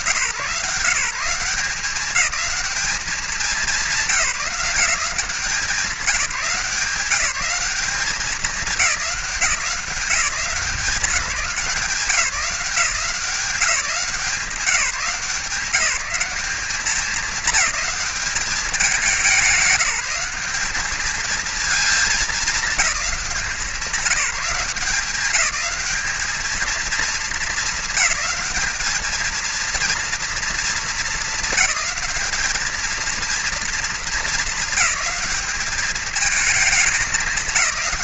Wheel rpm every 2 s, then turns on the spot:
160, 190, 170, 180, 180, 190, 180, 180, 210, 200, 210, 190, 180, 220, 220, 220, 230, 210, 210.
none